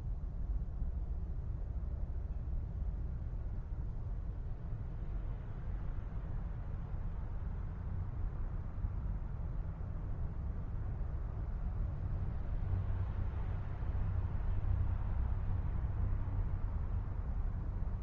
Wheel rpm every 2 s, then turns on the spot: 0, 0, 0, 0, 0, 0, 0, 0, 0.
none